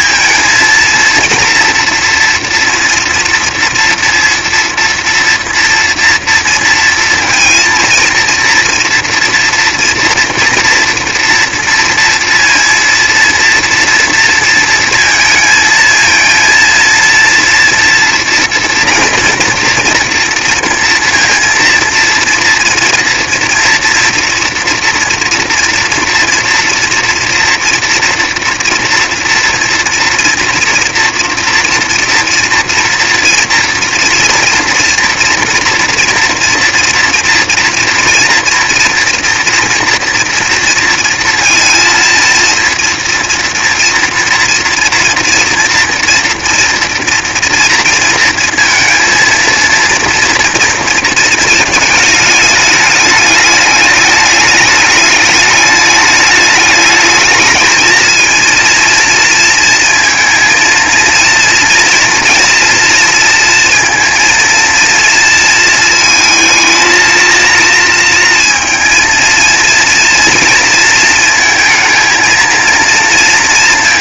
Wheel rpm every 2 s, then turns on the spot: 230, 230, 230, 230, 230, 230, 230, 230, 230, 230, 230, 230, 230, 230, 230, 230, 230, 230, 230, 230, 230, 230, 230, 230, 230, 240, 210, 210, 210, 230, 230, 230, 230, 220, 230, 230, 230.
none